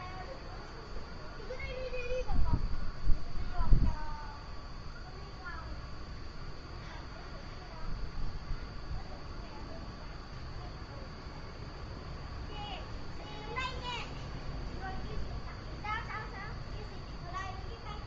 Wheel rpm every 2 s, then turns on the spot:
0, 0, 0, 0, 0, 0, 0, 0, 0.
none